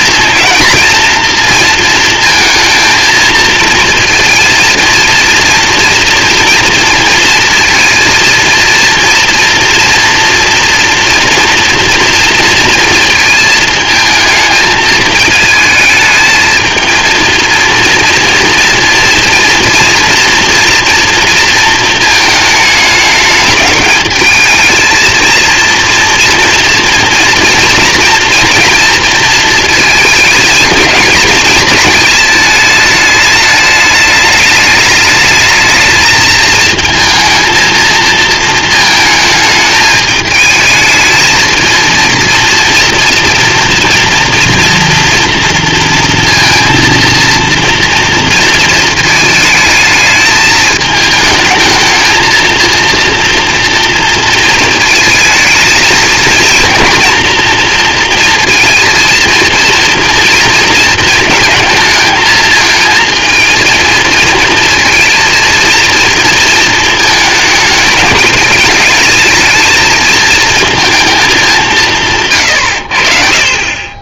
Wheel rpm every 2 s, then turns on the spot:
240, 230, 230, 230, 230, 230, 230, 220, 230, 230, 230, 210, 230, 240, 230, 220, 210, 210, 230, 220, 220, 230, 230, 230, 220, 220, 230, 220, 230, 230, 230, 220, 230, 220, 210, 220, 60.
none